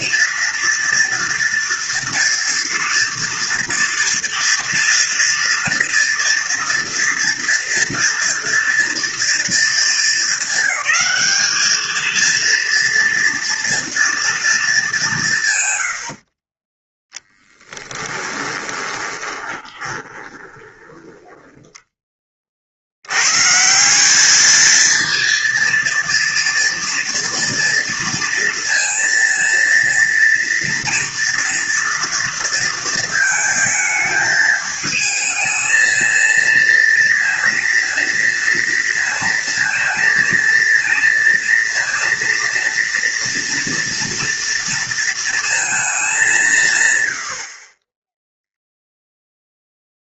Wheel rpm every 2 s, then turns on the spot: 230, 230, 230, 230, 230, 220, 230, 220, 20, 20, 20, 60, 220, 230, 230, 230, 230, 220, 230, 230, 230, 230, 230, 150, 0.
16-22